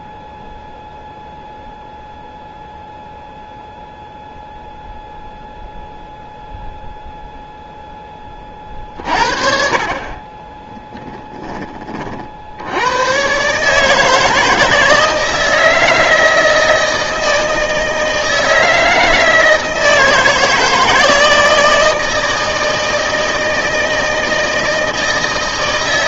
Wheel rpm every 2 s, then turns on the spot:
0, 0, 0, 0, 40, 10, 80, 160, 160, 160, 160, 160, 160.
10-12